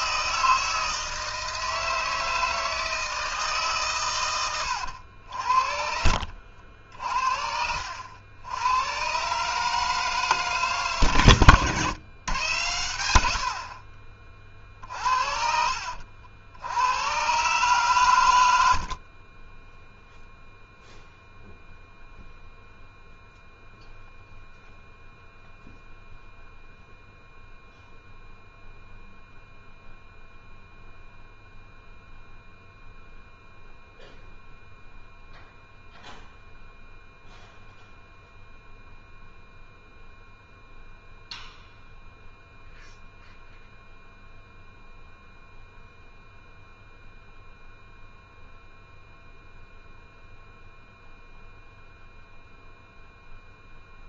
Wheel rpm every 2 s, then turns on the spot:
160, 160, 90, 60, 110, 140, 100, 40, 90, 70, 0, 0, 0, 0, 0, 0, 0, 0, 0, 0, 0, 0, 0, 0, 0, 0, 0.
18-20